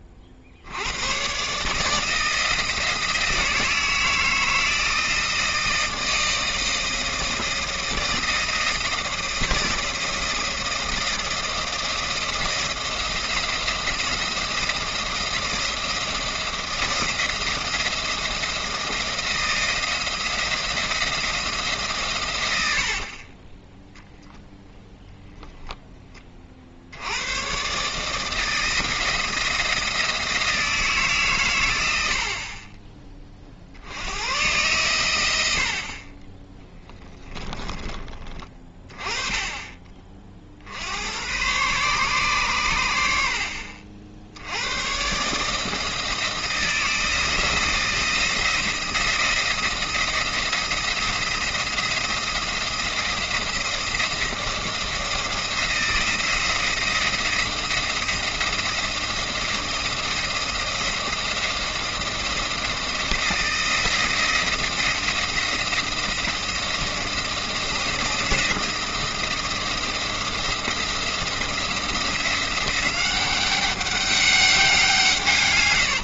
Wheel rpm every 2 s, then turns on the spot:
80, 160, 160, 160, 160, 160, 160, 170, 170, 170, 170, 70, 0, 50, 160, 160, 20, 120, 10, 30, 70, 100, 110, 170, 170, 170, 170, 170, 170, 170, 170, 160, 170, 170, 170, 170, 180, 190.
22-24 36-38